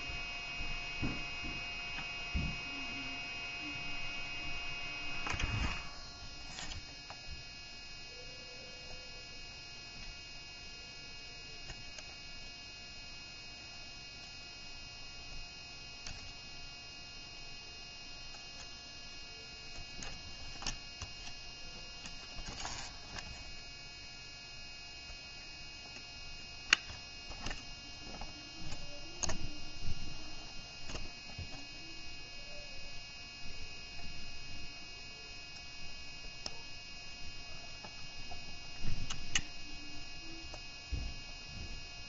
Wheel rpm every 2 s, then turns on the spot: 0, 0, 0, 0, 0, 0, 0, 0, 0, 0, 0, 0, 0, 0, 0, 0, 0, 0, 0, 0, 0.
none